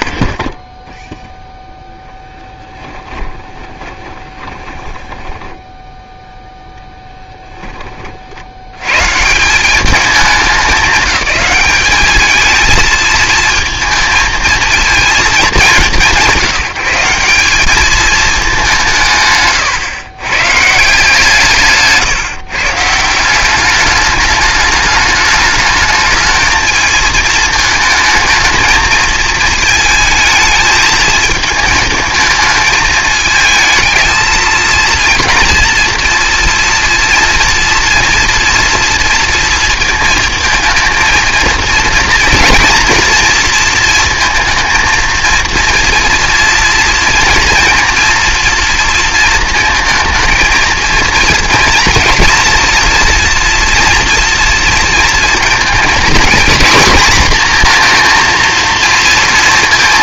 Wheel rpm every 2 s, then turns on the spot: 0, 10, 20, 0, 70, 190, 220, 220, 170, 200, 140, 140, 210, 220, 220, 220, 220, 230, 230, 230, 230, 230, 220, 230, 230, 230, 240, 230, 240, 230.
2-6